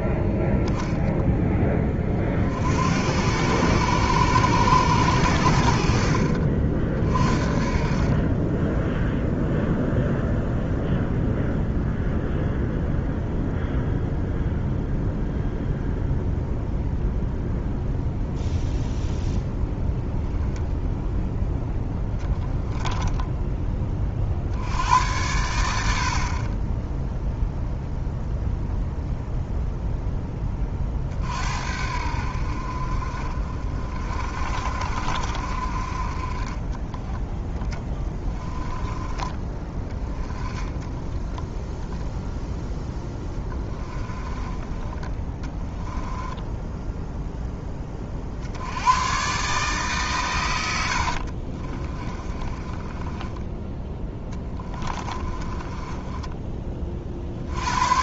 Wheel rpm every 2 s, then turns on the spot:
0, 70, 100, 40, 10, 0, 0, 0, 0, 0, 0, 10, 80, 20, 0, 30, 50, 50, 10, 20, 10, 0, 20, 10, 80, 90, 20, 20, 40.
8-10 22-24 38-40 44-48 52-56